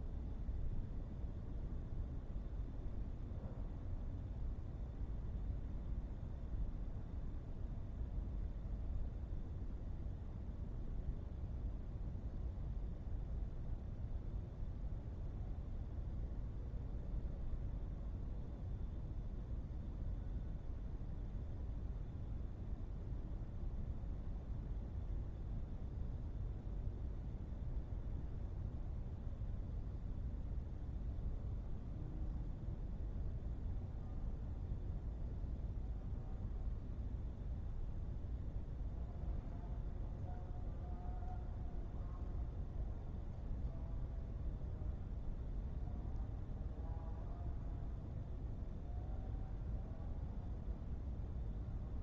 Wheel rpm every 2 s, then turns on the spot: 0, 0, 0, 0, 0, 0, 0, 0, 0, 0, 0, 0, 0, 0, 0, 0, 0, 0, 0, 0, 0, 0, 0, 0, 0, 0.
none